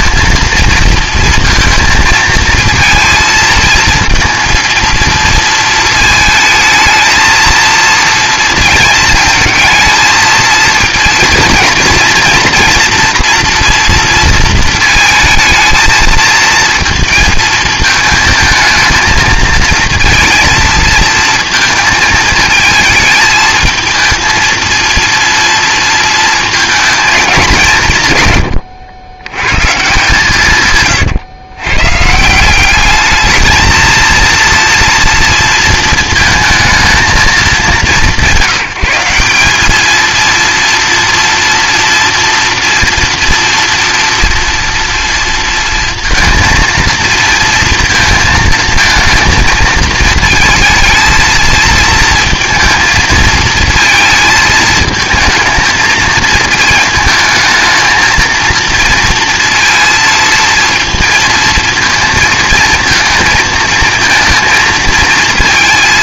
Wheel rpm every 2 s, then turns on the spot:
230, 230, 230, 220, 220, 230, 240, 220, 220, 220, 230, 220, 230, 230, 110, 130, 190, 230, 220, 180, 230, 230, 230, 230, 220, 230, 220, 220, 220, 230, 230, 220, 230.
28-30